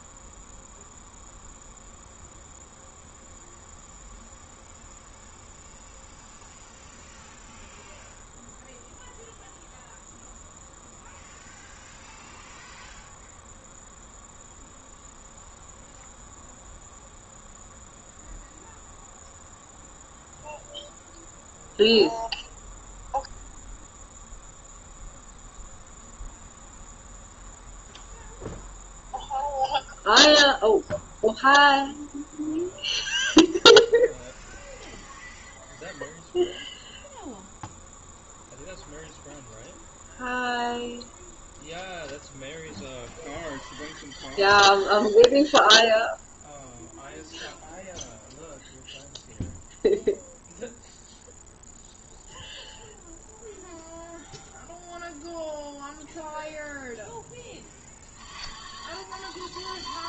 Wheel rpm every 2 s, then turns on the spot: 0, 0, 0, 0, 0, 0, 0, 0, 0, 0, 0, 0, 0, 0, 0, 0, 0, 0, 0, 0, 0, 0, 0, 0, 0, 0, 0, 0, 0, 0.
none